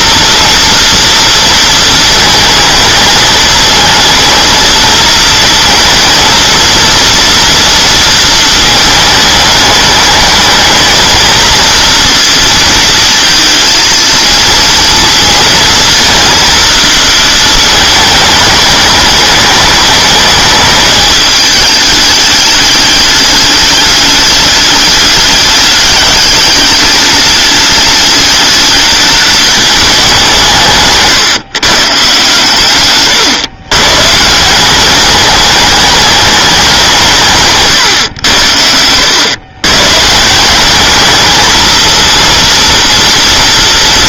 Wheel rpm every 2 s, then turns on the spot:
230, 220, 230, 230, 220, 220, 230, 230, 230, 210, 210, 210, 210, 210, 210, 150, 130, 190, 180, 100, 200, 230.
38-40